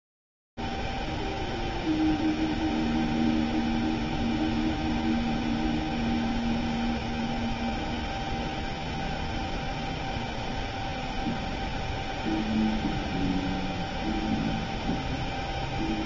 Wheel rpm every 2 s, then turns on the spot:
0, 0, 0, 0, 0, 0, 0, 0.
none